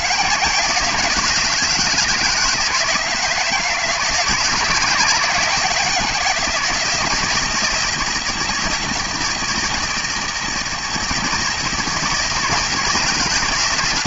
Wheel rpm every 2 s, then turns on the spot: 170, 160, 160, 160, 160, 160, 160.
none